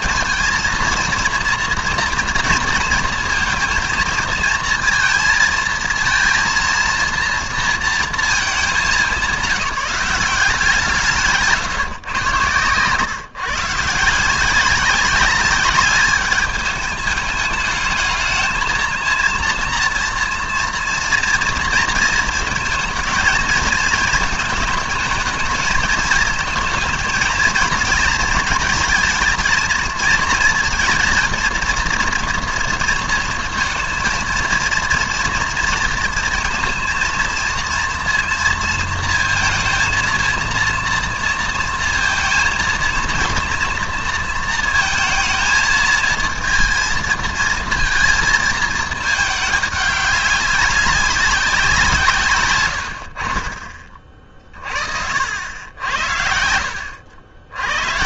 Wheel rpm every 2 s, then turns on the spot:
230, 230, 230, 230, 210, 170, 120, 180, 210, 220, 230, 220, 220, 230, 230, 220, 230, 230, 230, 230, 230, 230, 220, 230, 220, 200, 110, 40, 70.
none